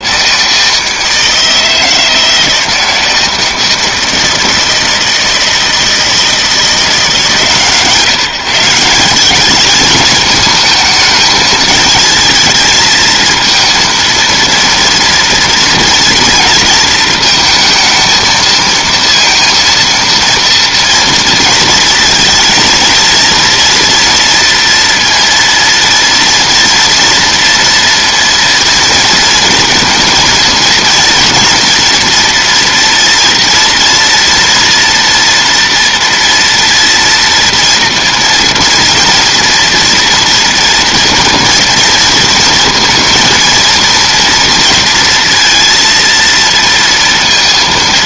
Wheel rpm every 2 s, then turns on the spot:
160, 160, 160, 160, 170, 220, 220, 230, 230, 230, 230, 230, 230, 230, 230, 230, 230, 240, 230, 230, 230, 230, 230, 230.
none